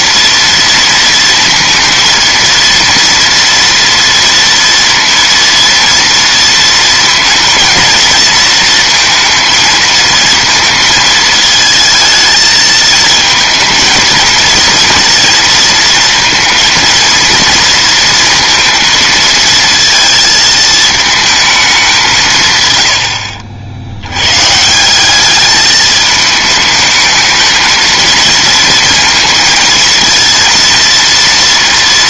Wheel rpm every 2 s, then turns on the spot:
230, 230, 230, 230, 230, 230, 220, 230, 230, 230, 220, 110, 140, 210, 230, 230.
none